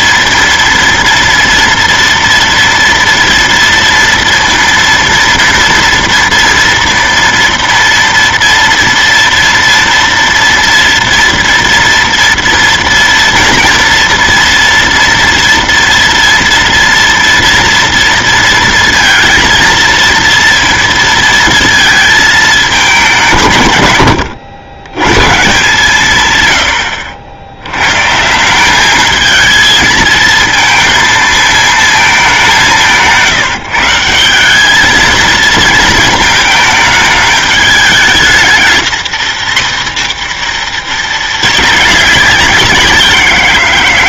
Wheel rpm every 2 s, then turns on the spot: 230, 230, 230, 230, 230, 230, 230, 230, 230, 230, 230, 190, 100, 90, 200, 230, 180, 210, 220, 220, 210, 180.
none